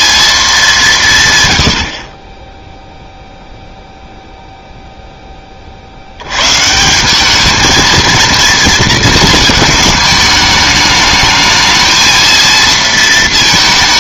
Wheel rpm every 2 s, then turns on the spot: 210, 10, 0, 140, 230, 210, 230.
none